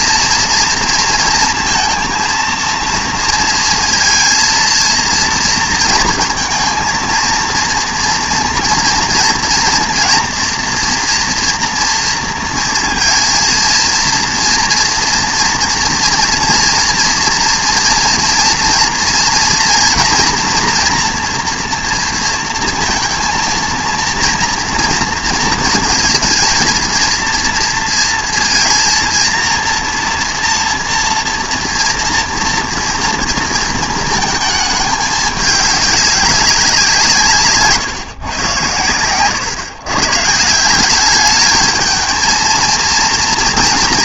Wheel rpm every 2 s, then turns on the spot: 230, 230, 230, 230, 230, 230, 230, 230, 230, 230, 240, 230, 230, 230, 230, 230, 230, 210, 180, 110, 170, 230.
none